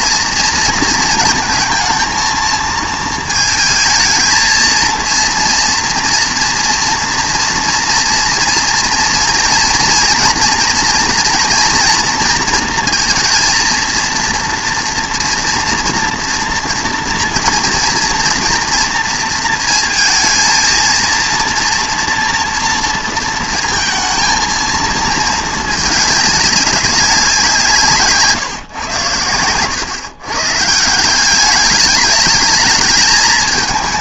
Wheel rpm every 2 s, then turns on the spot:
230, 230, 230, 230, 230, 240, 230, 230, 230, 230, 230, 230, 230, 200, 130, 160, 210.
none